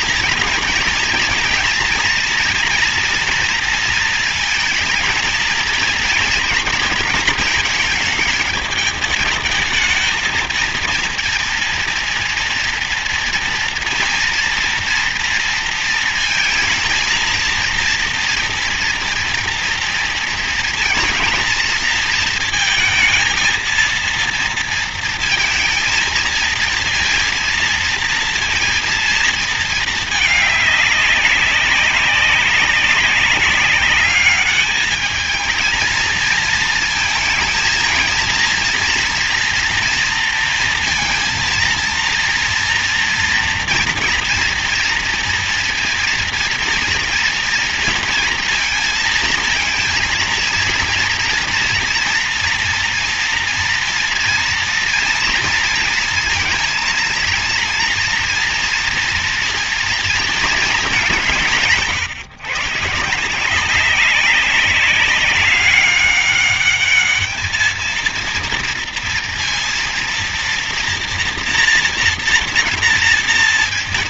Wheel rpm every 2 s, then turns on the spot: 230, 230, 230, 230, 210, 220, 230, 230, 220, 230, 230, 230, 230, 230, 230, 210, 190, 200, 220, 230, 230, 240, 230, 230, 230, 230, 230, 230, 230, 240, 220, 140, 190, 200, 230, 240, 230.
none